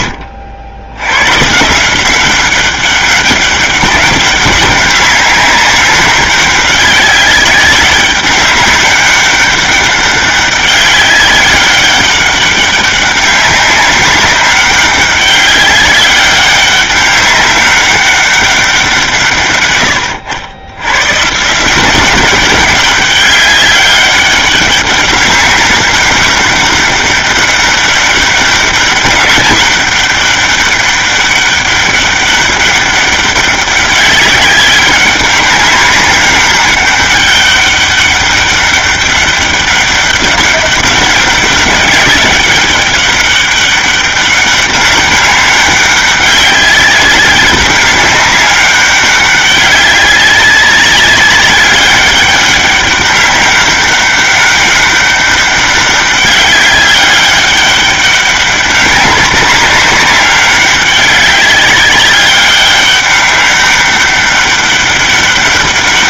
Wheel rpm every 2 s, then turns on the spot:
80, 200, 200, 200, 200, 200, 200, 200, 200, 180, 110, 200, 200, 200, 200, 200, 200, 200, 200, 200, 200, 200, 200, 200, 200, 190, 200, 200, 200, 190, 200, 200, 200.
none